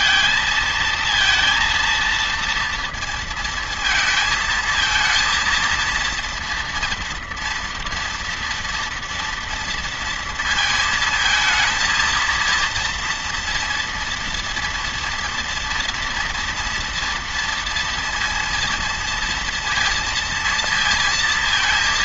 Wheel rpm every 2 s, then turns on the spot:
230, 230, 230, 230, 230, 220, 230, 230, 230, 230, 230.
none